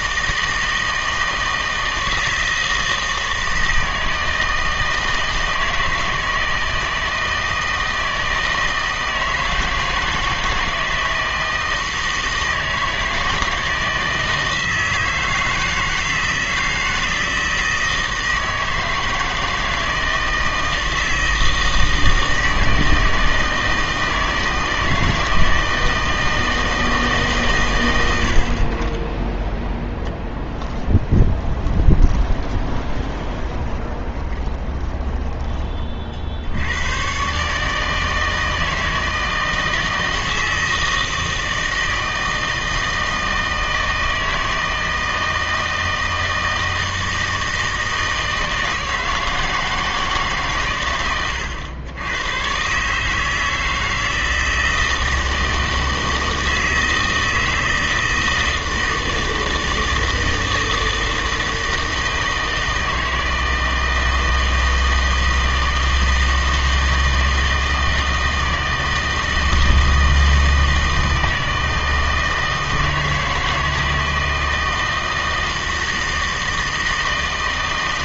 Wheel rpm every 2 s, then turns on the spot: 160, 160, 160, 160, 160, 160, 160, 160, 160, 160, 160, 160, 160, 160, 30, 10, 10, 20, 100, 160, 160, 160, 160, 160, 160, 120, 140, 160, 160, 160, 160, 160, 160, 160, 160, 160, 160, 160, 160.
30-36